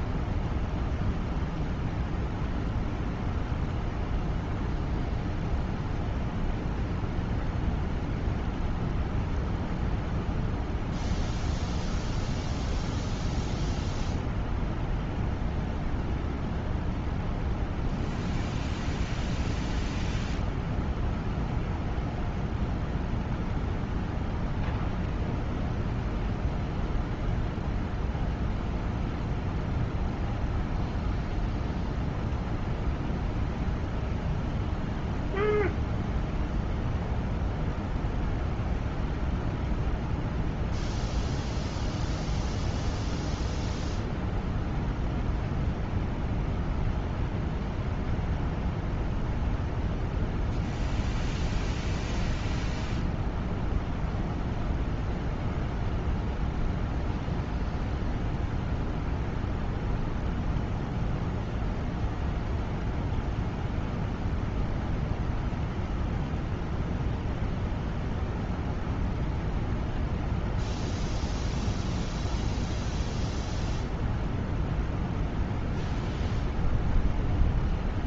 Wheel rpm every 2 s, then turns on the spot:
0, 0, 0, 0, 0, 0, 0, 0, 0, 0, 0, 0, 0, 0, 0, 0, 0, 0, 0, 0, 0, 0, 0, 0, 0, 0, 0, 0, 0, 0, 0, 0, 0, 0, 0, 0, 0, 0, 0.
none